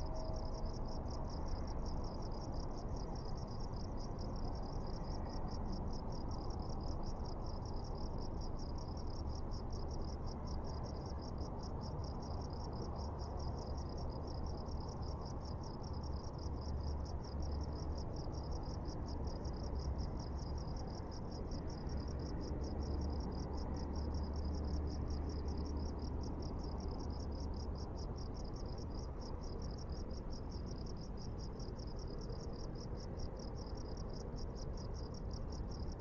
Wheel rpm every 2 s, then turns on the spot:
0, 0, 0, 0, 0, 0, 0, 0, 0, 0, 0, 0, 0, 0, 0, 0, 0, 0.
none